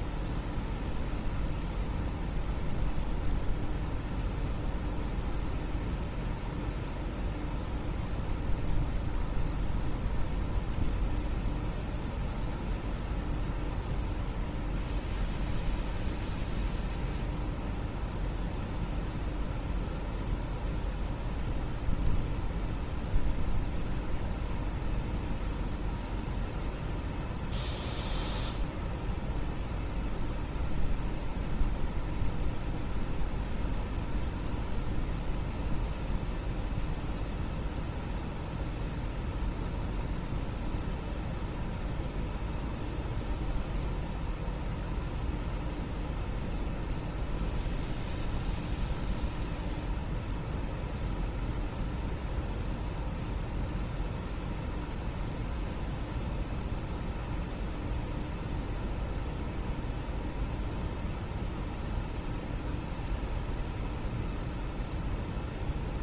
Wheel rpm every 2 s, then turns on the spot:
0, 0, 0, 0, 0, 0, 0, 0, 0, 0, 0, 0, 0, 0, 0, 0, 0, 0, 0, 0, 0, 0, 0, 0, 0, 0, 0, 0, 0, 0, 0, 0, 0.
none